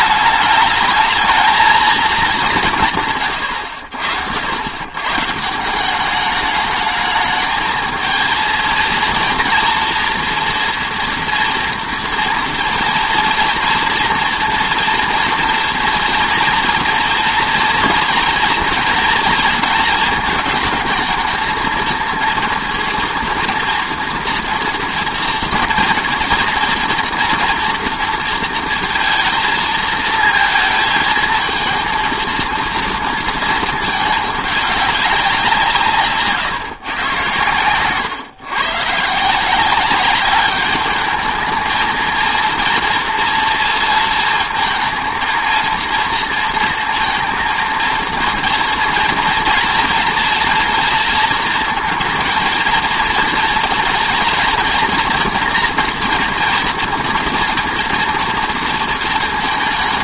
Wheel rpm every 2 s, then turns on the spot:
210, 190, 90, 210, 230, 230, 230, 230, 230, 220, 220, 230, 230, 230, 230, 230, 230, 200, 140, 120, 210, 240, 230, 230, 230, 230, 230, 240, 240, 230.
none